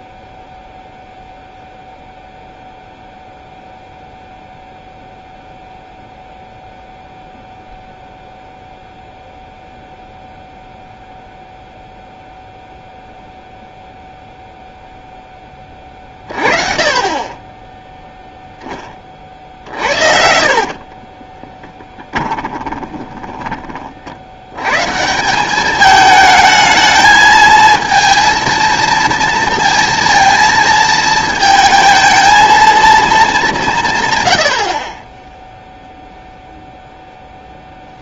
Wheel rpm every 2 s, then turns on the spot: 0, 0, 0, 0, 0, 0, 0, 0, 30, 10, 50, 10, 100, 220, 220, 230, 230, 70, 0.
20-24